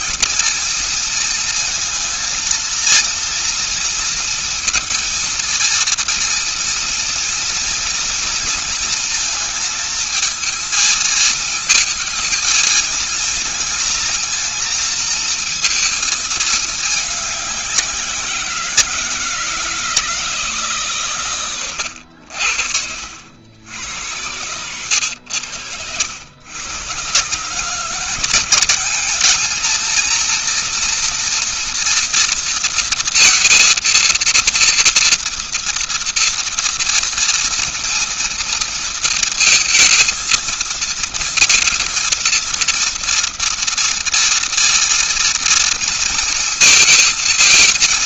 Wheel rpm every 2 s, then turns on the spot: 230, 230, 230, 230, 230, 220, 220, 230, 220, 180, 160, 70, 100, 110, 190, 230, 230, 230, 230, 230, 230, 230, 230, 220.
none